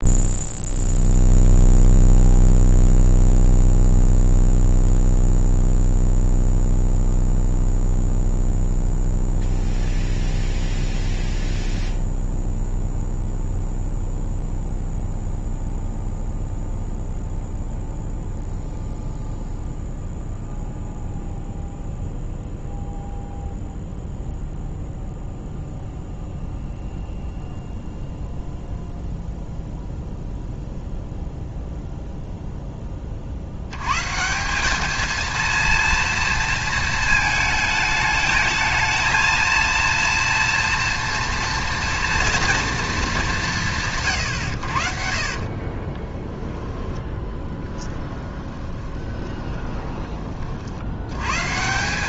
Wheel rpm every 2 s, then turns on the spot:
0, 0, 0, 0, 0, 0, 0, 0, 0, 0, 0, 0, 0, 0, 0, 0, 30, 210, 220, 220, 230, 220, 60, 20, 20, 80.
46-50